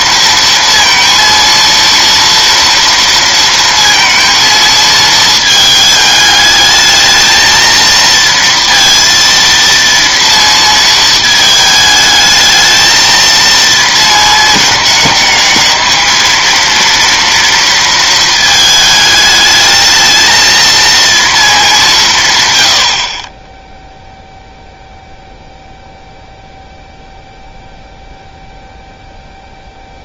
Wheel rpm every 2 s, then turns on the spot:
230, 230, 230, 210, 230, 230, 220, 220, 230, 220, 230, 120, 0, 0, 0.
none